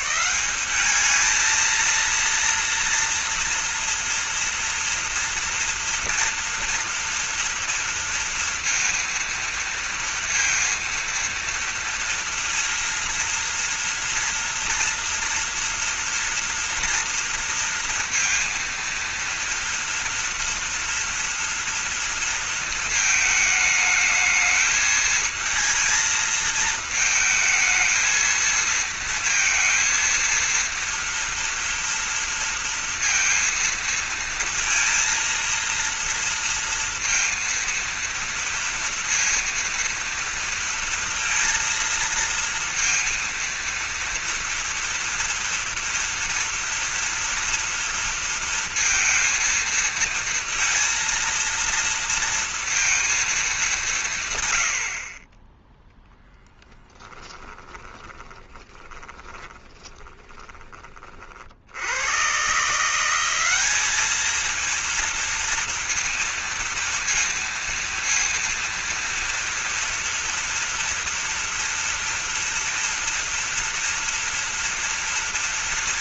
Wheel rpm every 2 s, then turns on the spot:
200, 230, 240, 230, 230, 230, 230, 230, 230, 230, 230, 220, 220, 220, 230, 230, 230, 230, 230, 230, 230, 230, 230, 230, 230, 230, 230, 80, 10, 20, 40, 160, 230, 230, 230, 230, 230, 230.
56-60